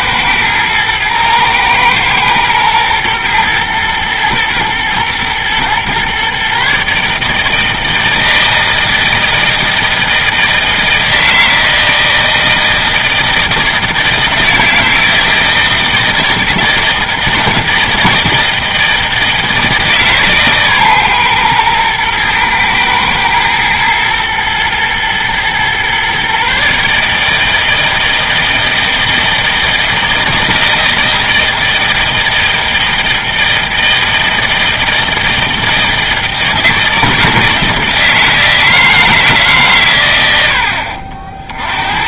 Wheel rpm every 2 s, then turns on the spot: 110, 110, 120, 140, 160, 160, 160, 160, 160, 160, 130, 120, 110, 150, 160, 160, 160, 160, 160, 160, 60.
none